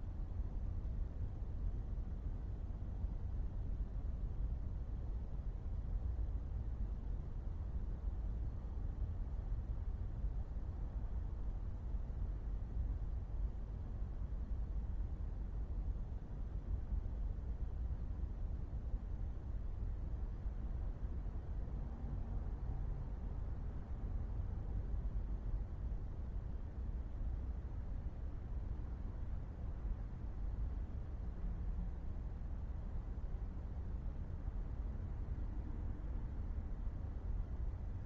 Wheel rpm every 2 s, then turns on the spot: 0, 0, 0, 0, 0, 0, 0, 0, 0, 0, 0, 0, 0, 0, 0, 0, 0, 0, 0.
none